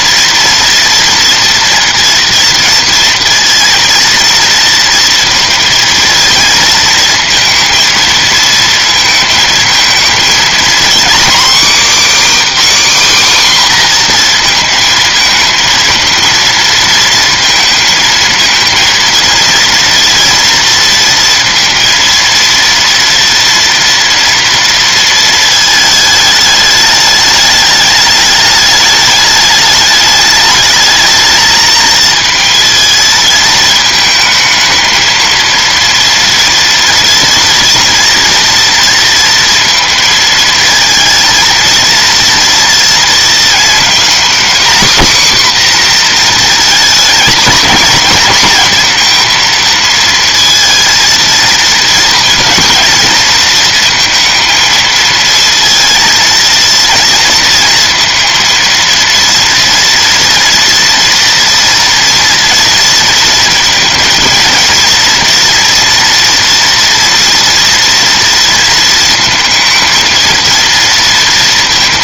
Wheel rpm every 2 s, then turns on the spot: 230, 230, 230, 230, 230, 240, 300, 230, 230, 230, 230, 230, 230, 210, 210, 220, 220, 220, 240, 230, 230, 230, 250, 230, 230, 230, 230, 230, 230, 230, 230, 230, 230, 230, 230, 230.
none